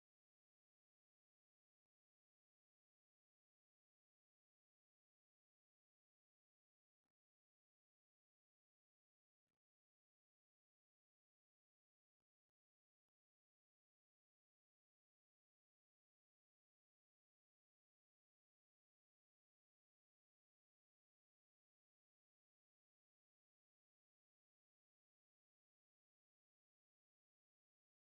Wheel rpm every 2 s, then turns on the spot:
0, 0, 0, 0, 0, 0, 0, 0, 0, 0, 0, 0, 0, 0.
none